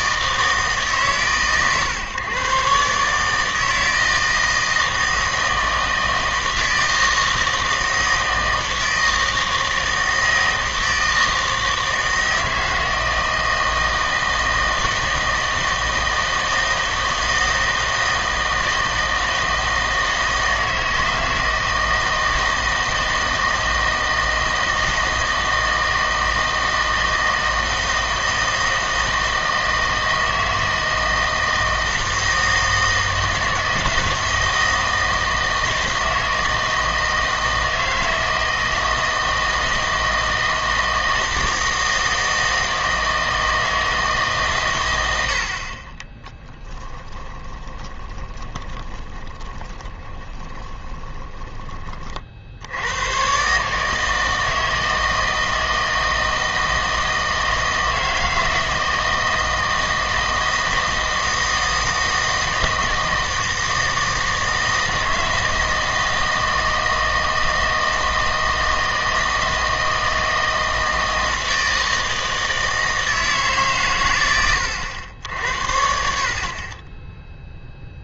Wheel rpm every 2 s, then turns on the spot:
150, 130, 160, 160, 160, 160, 160, 160, 160, 160, 160, 160, 160, 160, 160, 160, 160, 160, 160, 160, 160, 160, 130, 10, 20, 20, 80, 160, 160, 160, 160, 160, 160, 160, 160, 160, 160, 90, 30.
46-52